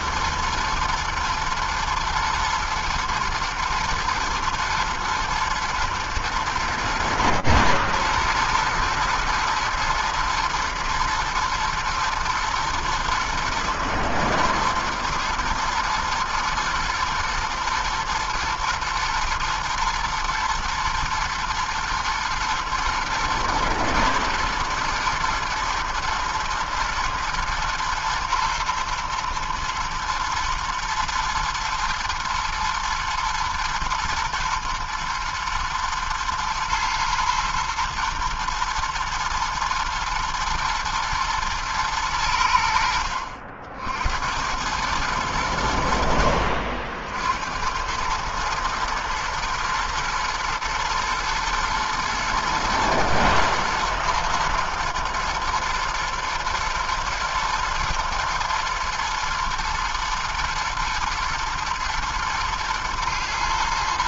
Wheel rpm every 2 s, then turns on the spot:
110, 110, 110, 110, 120, 110, 120, 120, 110, 110, 110, 120, 110, 120, 110, 120, 110, 120, 110, 110, 110, 90, 90, 60, 110, 120, 120, 120, 120, 110, 110, 110.
none